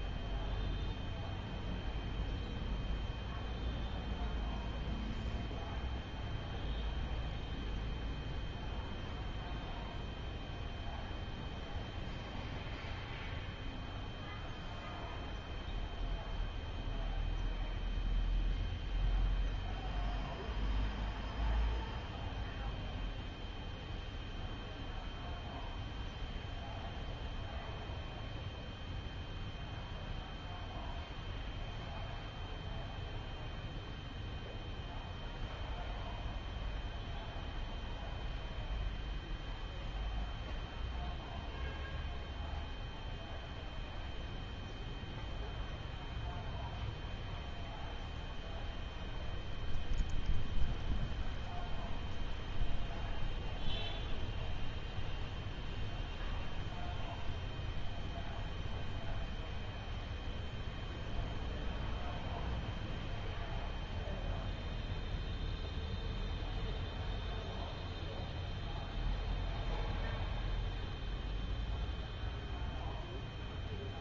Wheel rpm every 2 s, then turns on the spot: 0, 0, 0, 0, 0, 0, 0, 0, 0, 0, 0, 0, 0, 0, 0, 0, 0, 0, 0, 0, 0, 0, 0, 0, 0, 0, 0, 0, 0, 0, 0, 0, 0, 0, 0, 0, 0.
none